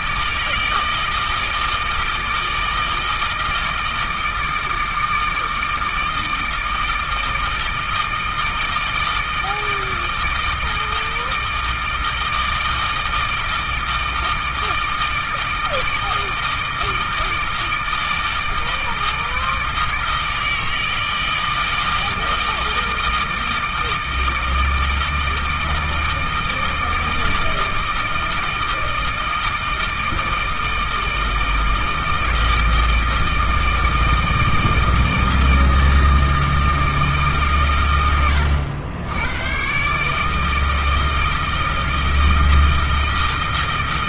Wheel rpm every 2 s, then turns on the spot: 160, 160, 160, 160, 160, 160, 160, 160, 160, 160, 160, 160, 160, 160, 160, 160, 160, 160, 160, 90, 160, 160.
none